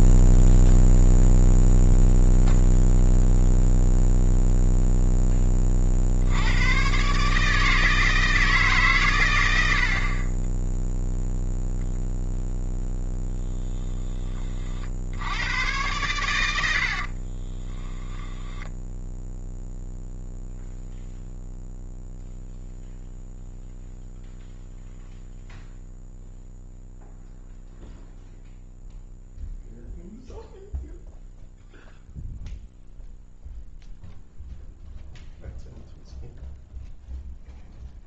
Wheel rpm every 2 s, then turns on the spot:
0, 0, 0, 130, 140, 0, 10, 60, 60, 0, 0, 0, 0, 0, 0, 0, 0, 0, 0.
none